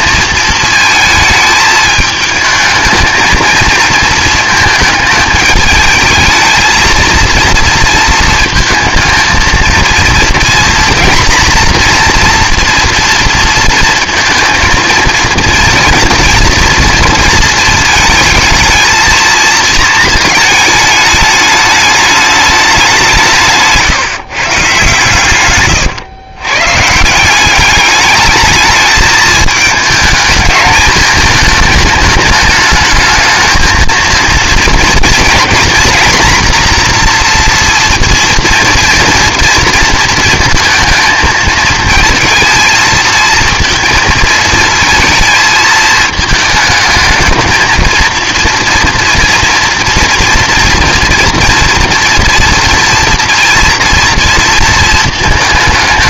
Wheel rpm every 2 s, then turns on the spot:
220, 220, 220, 220, 220, 240, 240, 230, 230, 220, 220, 200, 140, 140, 210, 220, 220, 230, 240, 230, 220, 230, 220, 220, 230, 230, 230, 230.
none